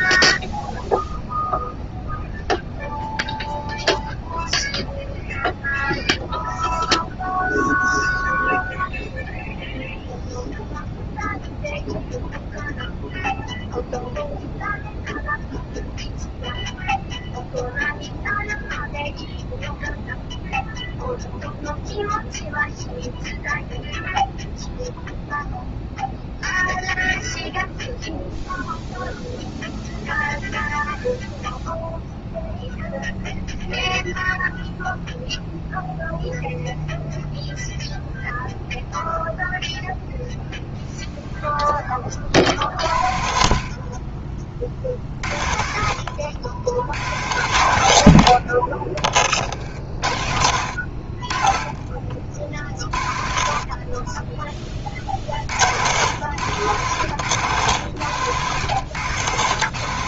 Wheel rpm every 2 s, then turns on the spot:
0, 0, 0, 0, 0, 0, 0, 0, 0, 0, 0, 0, 0, 0, 0, 0, 0, 0, 0, 0, 0, 60, 40, 70, 50, 70, 50, 30, 110, 120.
none